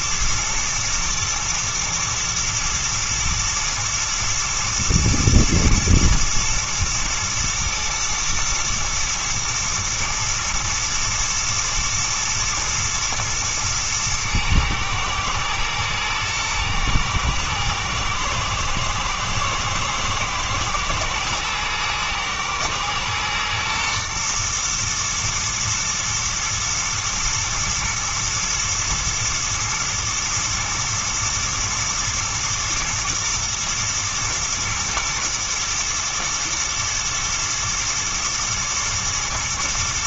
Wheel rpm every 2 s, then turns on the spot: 110, 120, 110, 110, 120, 110, 120, 110, 110, 110, 110, 110, 120, 120, 120, 110, 120, 110, 110, 120.
none